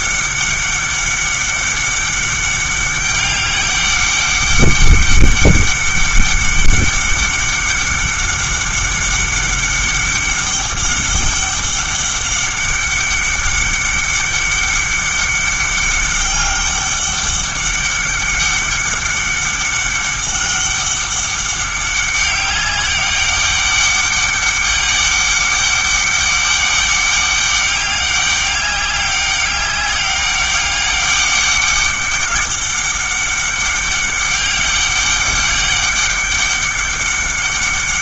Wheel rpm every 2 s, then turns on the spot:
200, 200, 200, 200, 200, 200, 200, 200, 200, 200, 200, 200, 200, 200, 200, 200, 190, 200, 200.
none